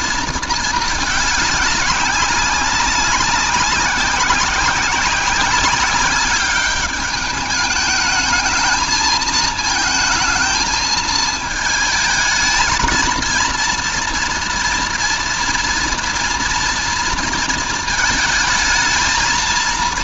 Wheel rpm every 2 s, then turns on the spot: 210, 200, 190, 210, 220, 220, 230, 230, 230, 220.
none